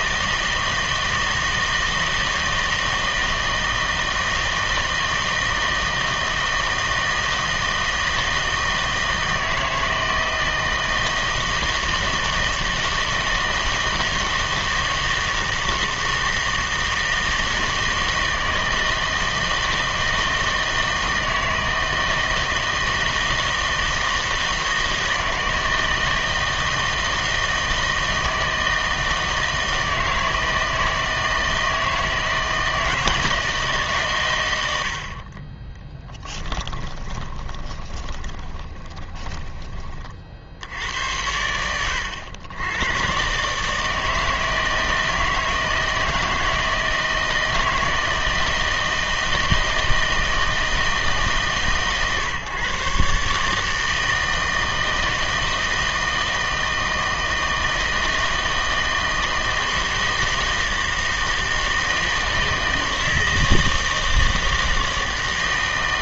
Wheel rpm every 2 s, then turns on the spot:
160, 160, 160, 160, 160, 160, 160, 160, 160, 160, 160, 160, 160, 160, 160, 160, 160, 100, 10, 20, 90, 90, 160, 160, 160, 160, 130, 160, 160, 160, 160, 160, 160.
36-40